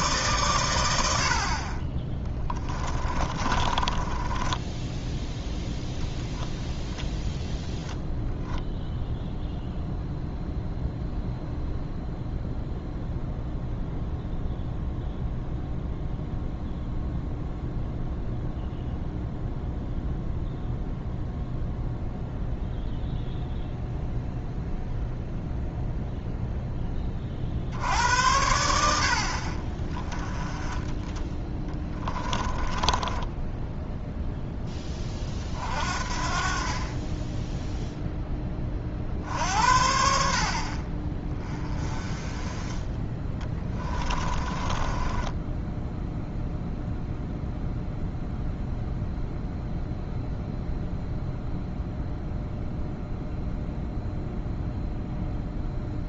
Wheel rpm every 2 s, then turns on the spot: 110, 10, 10, 0, 0, 0, 0, 0, 0, 0, 0, 0, 0, 0, 90, 30, 20, 10, 40, 20, 50, 20, 20, 0, 0, 0, 0, 0.
2-6 32-34 44-46